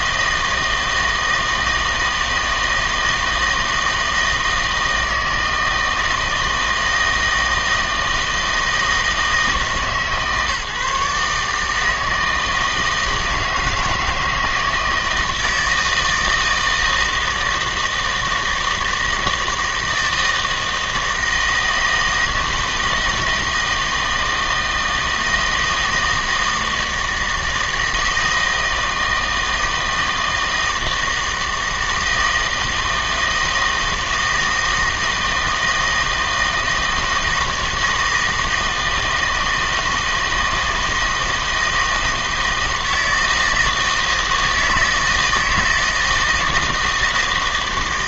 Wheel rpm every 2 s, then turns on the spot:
160, 160, 160, 160, 160, 140, 160, 160, 160, 160, 160, 160, 160, 160, 170, 160, 160, 160, 160, 160, 160, 160, 160, 160.
none